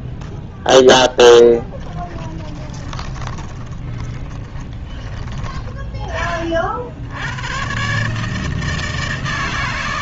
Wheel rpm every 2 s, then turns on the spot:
10, 20, 20, 110, 160.
0-4